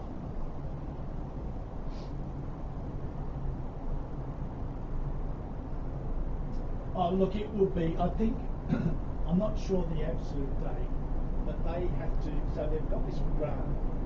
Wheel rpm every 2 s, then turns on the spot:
0, 0, 0, 0, 0, 0, 0.
none